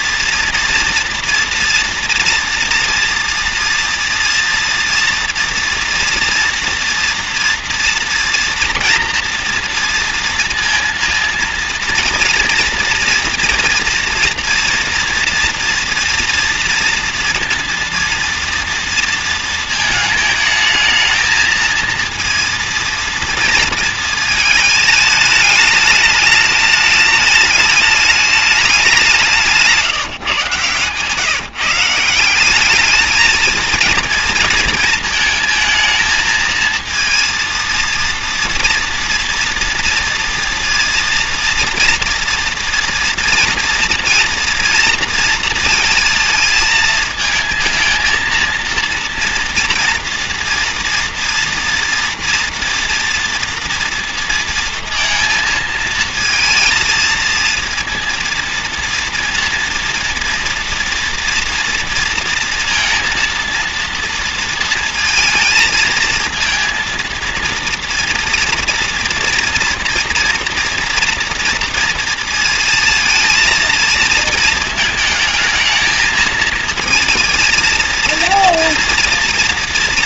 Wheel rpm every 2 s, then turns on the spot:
240, 230, 230, 230, 230, 230, 230, 230, 230, 230, 220, 230, 220, 210, 200, 140, 210, 220, 230, 230, 240, 230, 230, 220, 230, 240, 230, 230, 230, 230, 230, 230, 220, 230, 230, 240, 230, 220, 230, 230.
none